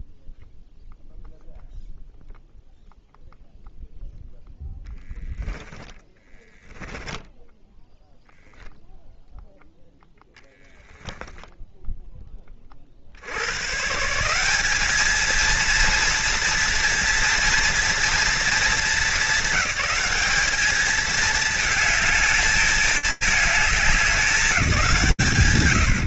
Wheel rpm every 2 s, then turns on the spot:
0, 0, 0, 10, 0, 0, 100, 220, 230, 210, 220, 210, 110.
6-8